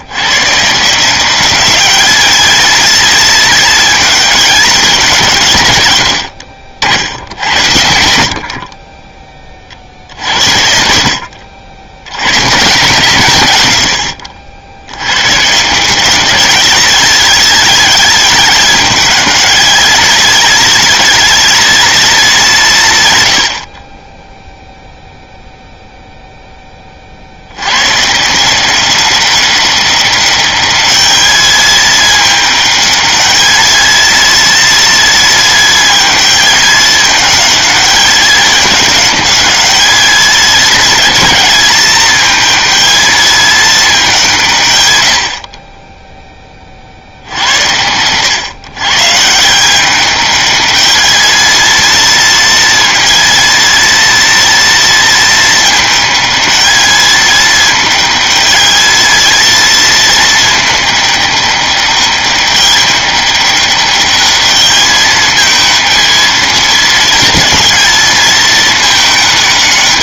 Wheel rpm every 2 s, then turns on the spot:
140, 220, 210, 70, 30, 70, 130, 70, 210, 210, 220, 180, 0, 20, 180, 210, 210, 230, 220, 210, 220, 220, 130, 40, 130, 210, 230, 230, 220, 220, 210, 200, 210, 220, 220.
10-12